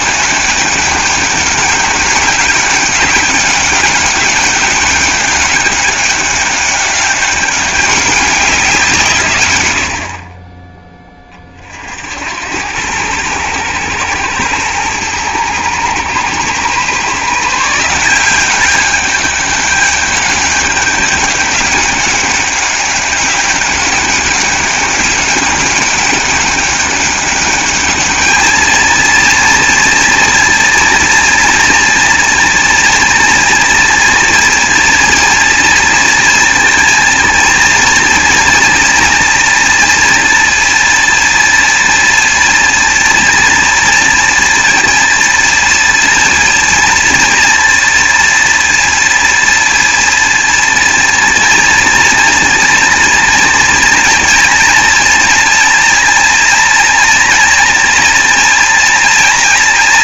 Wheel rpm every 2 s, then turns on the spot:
200, 200, 200, 200, 180, 20, 100, 110, 130, 190, 200, 200, 200, 200, 220, 230, 230, 240, 230, 230, 230, 230, 230, 230, 230, 230, 230, 230, 240, 230.
none